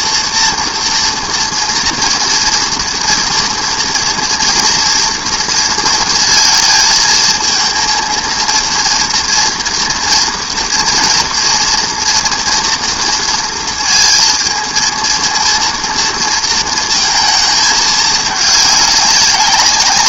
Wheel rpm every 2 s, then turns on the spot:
230, 230, 230, 220, 230, 230, 230, 230, 230, 210.
none